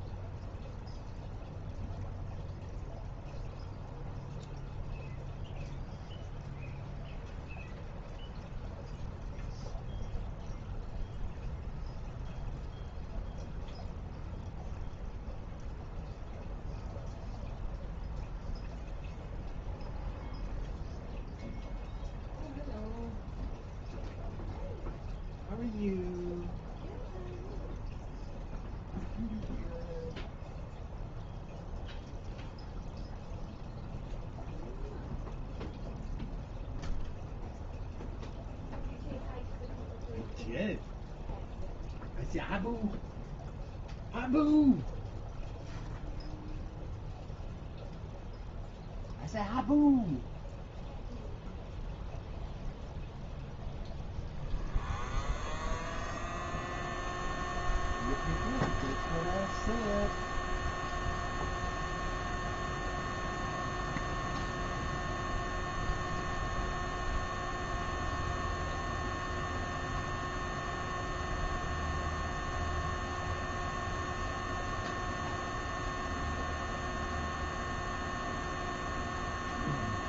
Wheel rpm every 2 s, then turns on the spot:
0, 0, 0, 0, 0, 0, 0, 0, 0, 0, 0, 0, 0, 0, 0, 0, 0, 0, 0, 0, 0, 0, 0, 0, 0, 0, 0, 0, 0, 0, 0, 0, 0, 0, 0, 0, 0, 0, 0, 0.
none